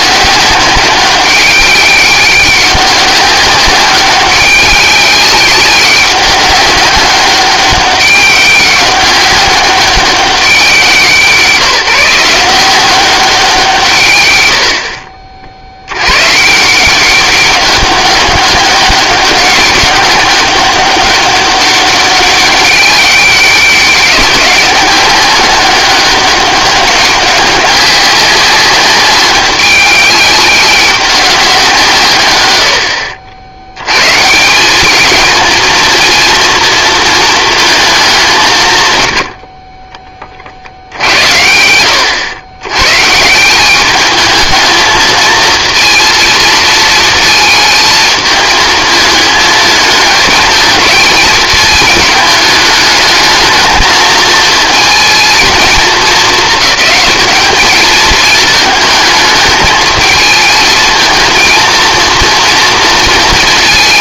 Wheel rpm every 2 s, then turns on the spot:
190, 200, 190, 190, 190, 180, 180, 80, 160, 200, 200, 200, 190, 200, 190, 190, 80, 190, 230, 140, 70, 110, 220, 230, 220, 230, 220, 230, 210, 220, 220, 230.
38-40